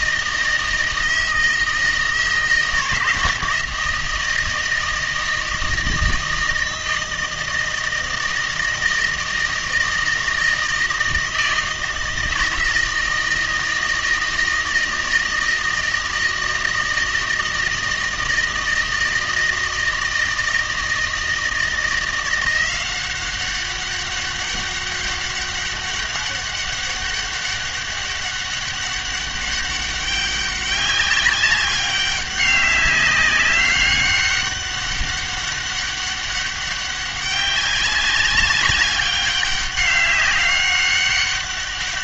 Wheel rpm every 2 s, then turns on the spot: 160, 160, 160, 160, 160, 160, 160, 160, 160, 160, 160, 180, 200, 200, 200, 200, 200, 200, 200, 200, 200.
none